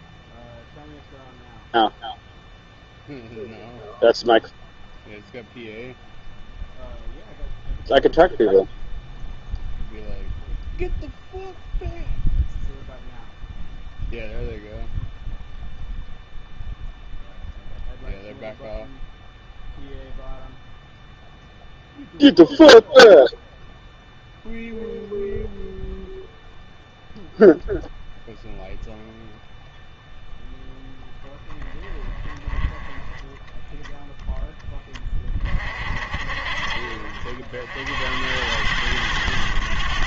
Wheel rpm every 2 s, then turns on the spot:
0, 0, 0, 0, 0, 0, 0, 0, 0, 0, 0, 0, 0, 0, 0, 0, 10, 20, 50, 100.
none